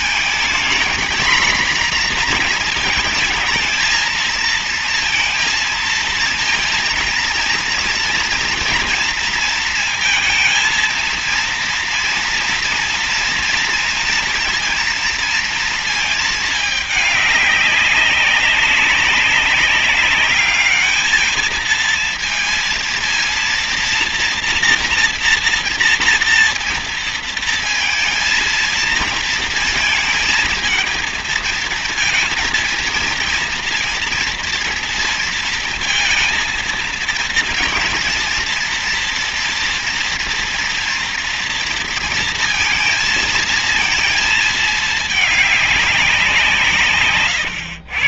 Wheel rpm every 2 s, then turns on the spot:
240, 230, 230, 230, 230, 230, 230, 230, 210, 200, 210, 230, 240, 240, 230, 220, 230, 230, 230, 230, 230, 230, 220, 180.
none